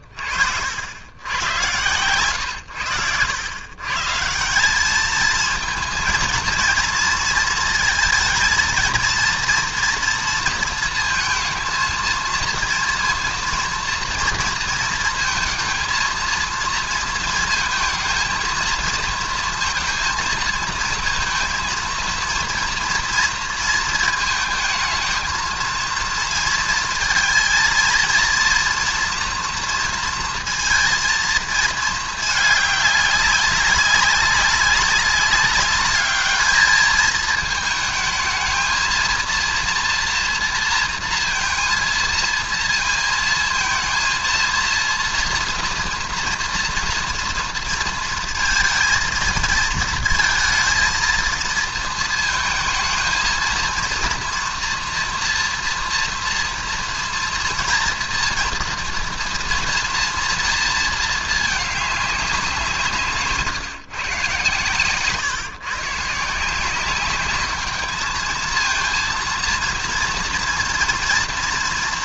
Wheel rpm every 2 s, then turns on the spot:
70, 110, 150, 230, 230, 230, 230, 230, 230, 230, 230, 230, 220, 230, 230, 230, 220, 200, 210, 220, 230, 230, 230, 230, 230, 230, 220, 230, 230, 230, 230, 190, 130, 150, 220, 230.
none